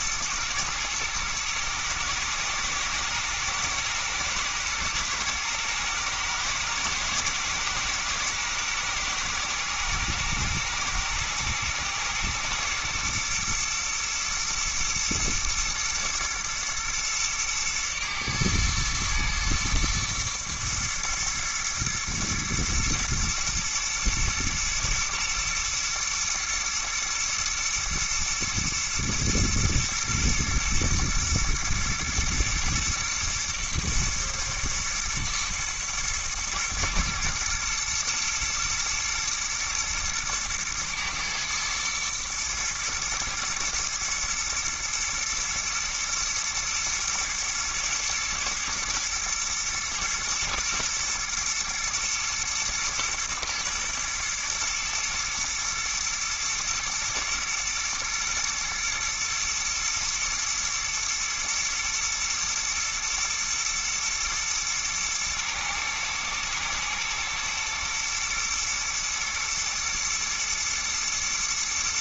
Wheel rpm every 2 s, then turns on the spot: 110, 110, 110, 110, 120, 110, 120, 120, 110, 110, 120, 110, 120, 110, 120, 120, 110, 110, 120, 120, 110, 120, 110, 120, 120, 120, 110, 110, 110, 120, 120, 120, 110, 110, 110, 120.
none